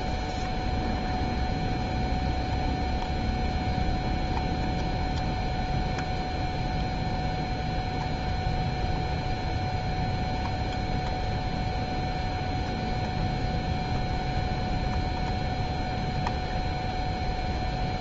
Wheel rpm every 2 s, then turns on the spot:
0, 0, 0, 0, 0, 0, 0, 0, 0.
none